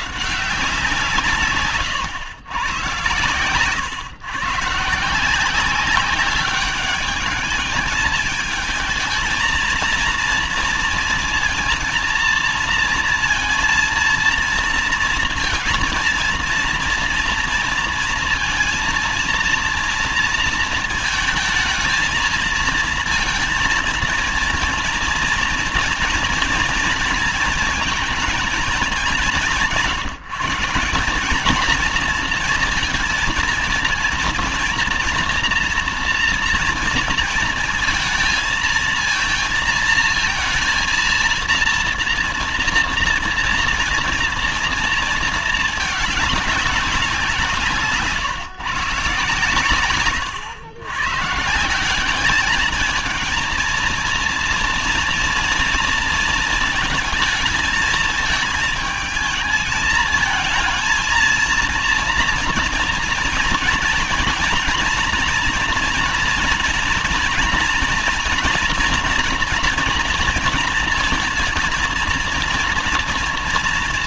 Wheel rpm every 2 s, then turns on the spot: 150, 110, 140, 200, 220, 230, 230, 230, 230, 230, 230, 230, 230, 230, 210, 170, 220, 230, 230, 230, 230, 230, 230, 200, 150, 120, 210, 230, 230, 220, 230, 230, 230, 220, 230, 230, 230.
none